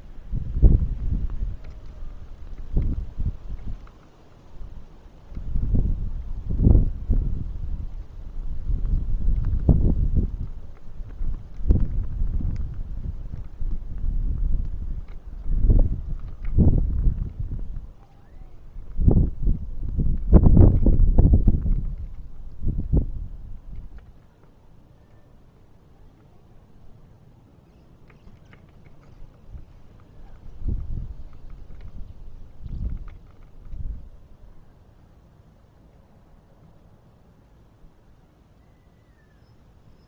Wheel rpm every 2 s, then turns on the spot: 0, 0, 0, 0, 0, 0, 0, 0, 0, 0, 0, 0, 0, 0, 0, 0, 0, 0, 0, 0.
none